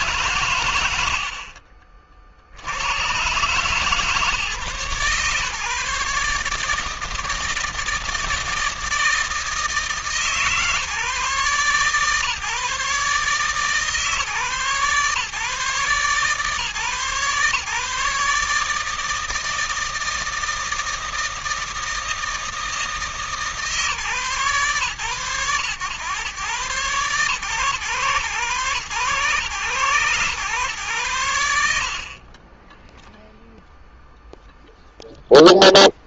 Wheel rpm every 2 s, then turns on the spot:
110, 100, 130, 160, 160, 150, 150, 140, 130, 160, 160, 160, 120, 120, 110, 100, 10, 0.
32-34